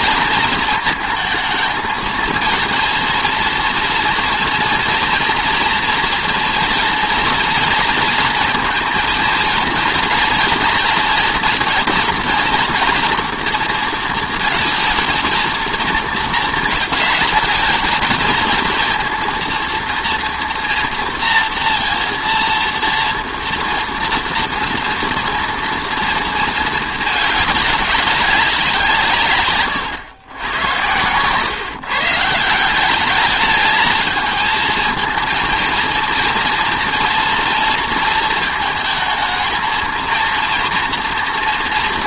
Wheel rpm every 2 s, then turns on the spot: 230, 230, 230, 230, 230, 230, 230, 230, 220, 230, 240, 240, 230, 220, 180, 100, 180, 220, 230, 220, 230.
none